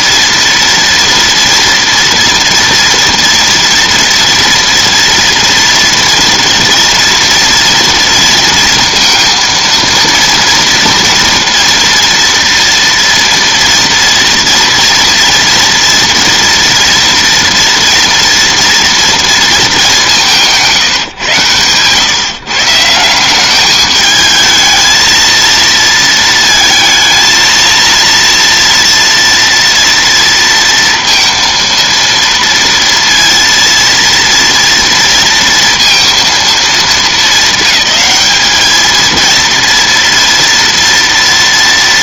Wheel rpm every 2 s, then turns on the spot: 230, 230, 240, 230, 230, 230, 230, 230, 230, 230, 170, 140, 220, 230, 240, 230, 230, 230, 220, 210, 230.
none